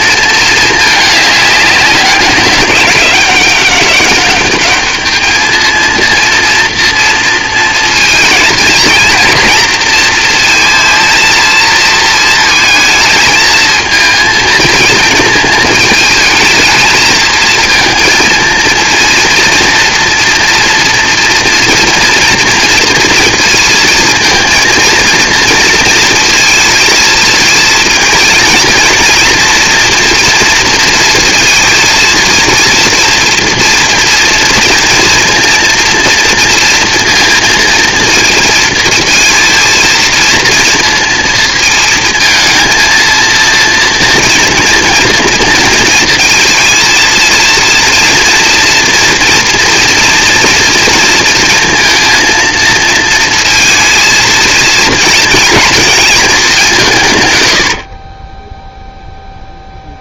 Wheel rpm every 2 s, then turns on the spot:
220, 190, 200, 230, 220, 230, 230, 220, 220, 230, 230, 230, 230, 230, 230, 230, 230, 230, 230, 230, 230, 220, 230, 230, 230, 240, 230, 230, 190, 10.
none